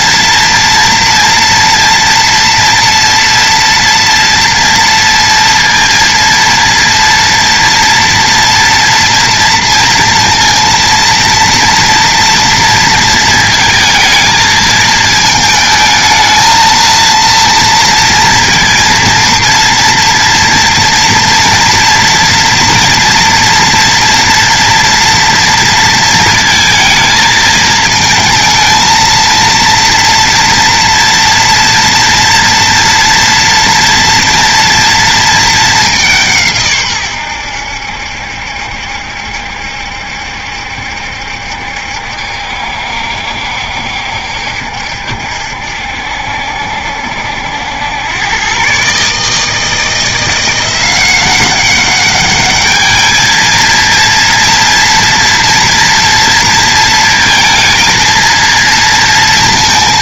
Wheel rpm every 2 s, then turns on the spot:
230, 230, 230, 230, 230, 230, 230, 220, 230, 230, 230, 240, 230, 220, 230, 230, 230, 230, 130, 70, 70, 70, 70, 70, 140, 180, 210, 230, 230, 230.
none